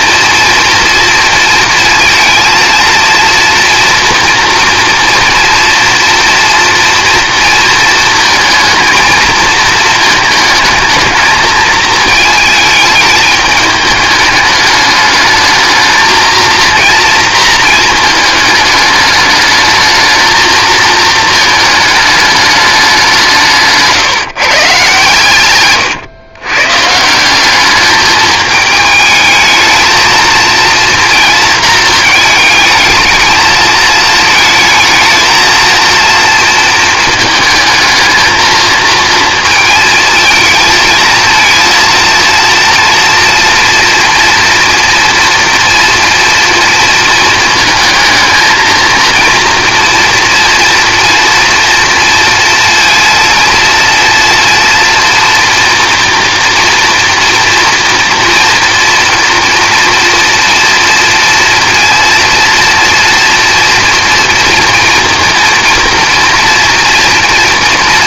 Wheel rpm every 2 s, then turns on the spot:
230, 230, 230, 230, 220, 220, 210, 210, 230, 210, 220, 200, 140, 140, 220, 230, 220, 220, 220, 220, 230, 230, 230, 230, 230, 230, 230, 230, 230, 230, 230, 230, 230, 230.
none